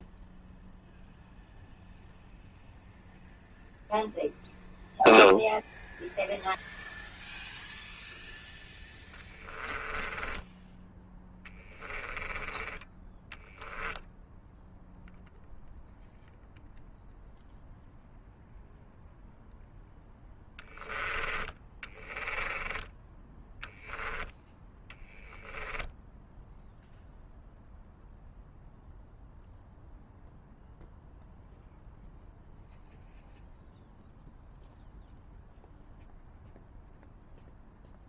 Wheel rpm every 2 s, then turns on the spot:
0, 0, 0, 0, 10, 10, 10, 0, 0, 0, 10, 30, 10, 0, 0, 0, 0, 0, 0.
8-10 24-26